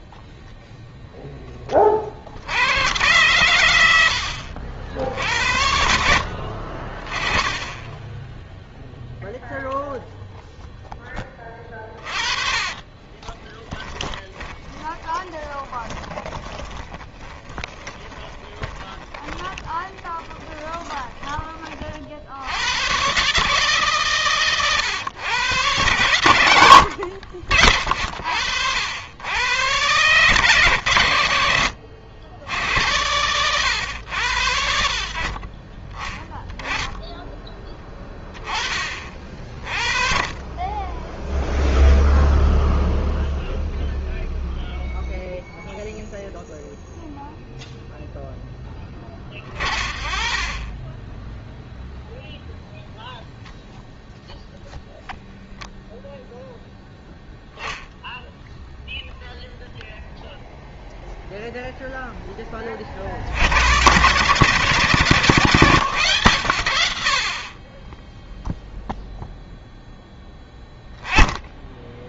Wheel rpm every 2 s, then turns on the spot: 0, 110, 70, 20, 0, 10, 20, 20, 20, 30, 30, 130, 130, 80, 100, 100, 90, 60, 10, 30, 10, 0, 0, 0, 10, 20, 0, 0, 0, 0, 0, 20, 120, 90, 0, 10.
12-20